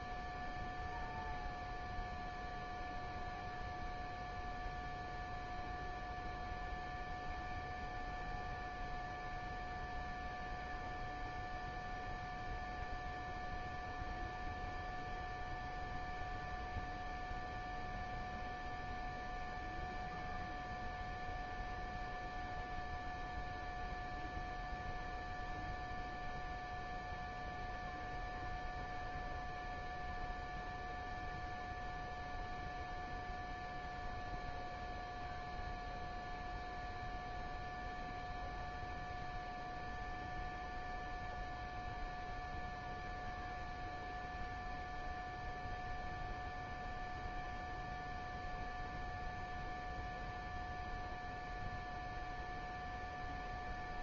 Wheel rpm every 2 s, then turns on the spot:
0, 0, 0, 0, 0, 0, 0, 0, 0, 0, 0, 0, 0, 0, 0, 0, 0, 0, 0, 0, 0, 0, 0, 0, 0, 0, 0.
none